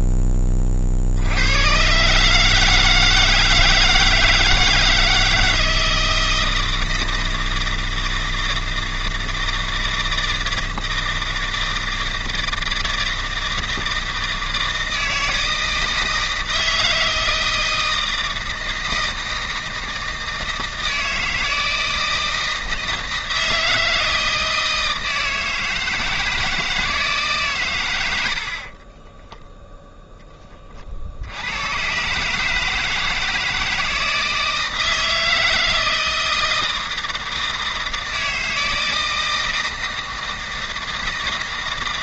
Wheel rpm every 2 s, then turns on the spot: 30, 150, 160, 160, 160, 160, 160, 160, 160, 160, 160, 160, 160, 160, 40, 30, 160, 160, 160, 160, 160.
28-30